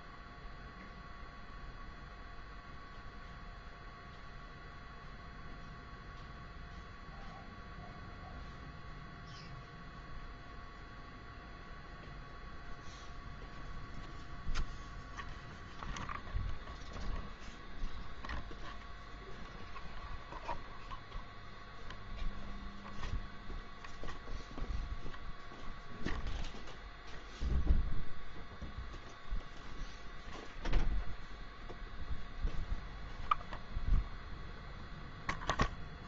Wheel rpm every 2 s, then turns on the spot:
0, 0, 0, 0, 0, 0, 0, 0, 0, 0, 0, 0, 0, 0, 0, 0, 0, 0.
none